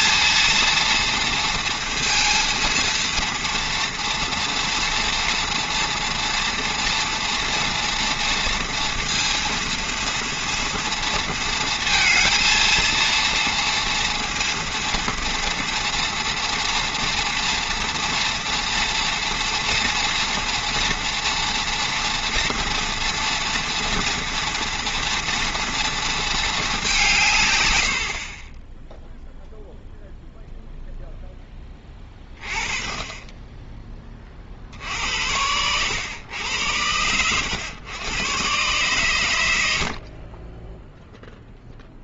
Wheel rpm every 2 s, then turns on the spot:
230, 230, 230, 230, 230, 230, 230, 230, 230, 230, 230, 240, 230, 210, 20, 0, 20, 50, 100, 120, 20.
28-30